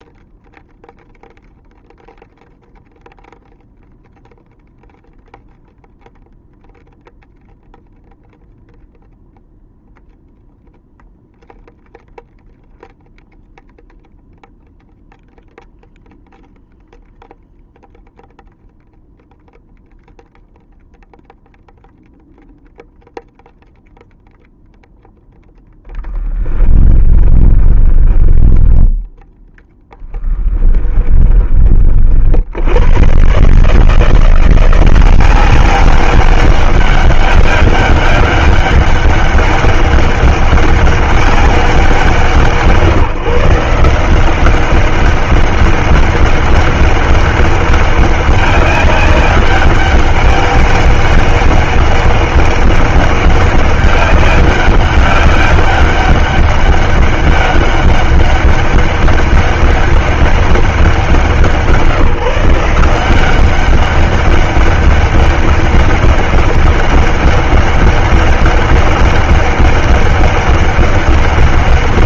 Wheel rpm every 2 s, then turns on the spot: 0, 0, 0, 0, 0, 0, 0, 0, 0, 0, 0, 0, 0, 10, 20, 10, 50, 160, 190, 200, 200, 180, 180, 200, 200, 200, 200, 200, 200, 200, 200, 160, 190, 200, 200, 200.
26-32